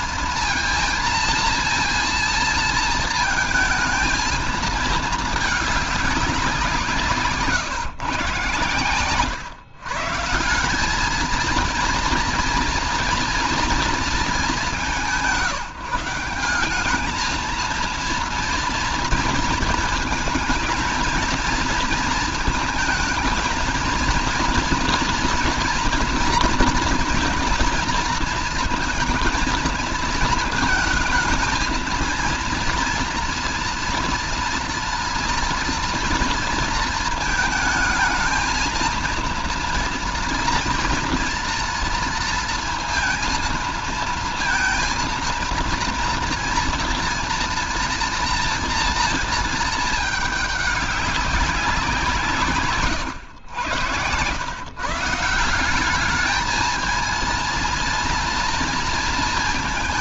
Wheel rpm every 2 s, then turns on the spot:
220, 230, 220, 180, 120, 170, 230, 200, 190, 230, 220, 230, 230, 230, 230, 220, 230, 230, 230, 220, 240, 230, 230, 230, 230, 210, 150, 130, 220, 230.
52-54